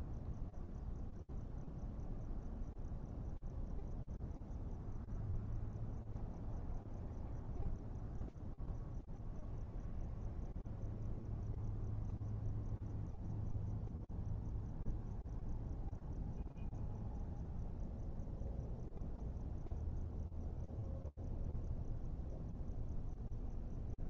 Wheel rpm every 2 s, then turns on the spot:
0, 0, 0, 0, 0, 0, 0, 0, 0, 0, 0, 0.
none